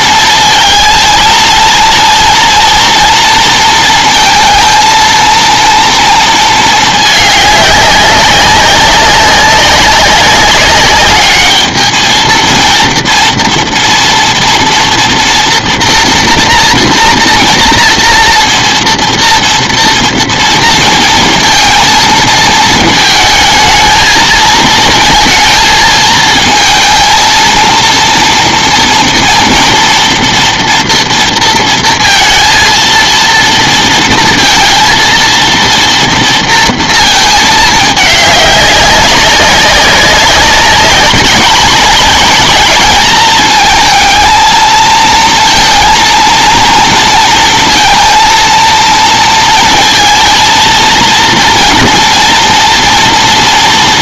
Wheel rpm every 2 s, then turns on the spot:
230, 230, 230, 220, 200, 200, 230, 240, 230, 230, 230, 220, 220, 220, 230, 240, 230, 230, 230, 200, 200, 210, 230, 230, 230, 230, 230.
none